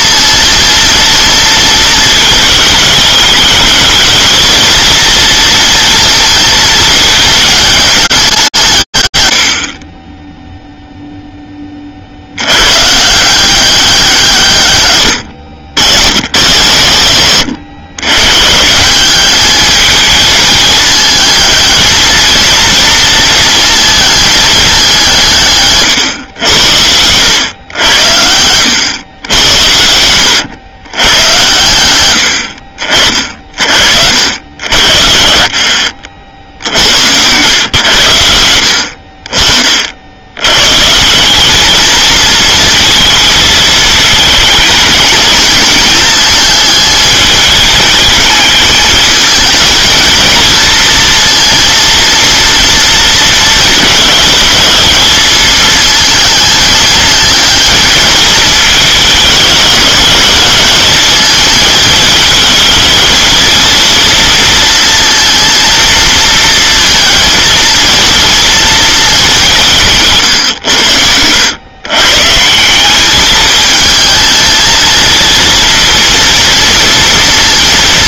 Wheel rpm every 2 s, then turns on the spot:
230, 210, 220, 220, 160, 0, 120, 130, 110, 160, 220, 230, 200, 90, 100, 110, 50, 60, 100, 50, 160, 220, 220, 220, 220, 220, 230, 220, 220, 210, 220, 230, 230, 230, 210, 90, 200, 230, 230.
none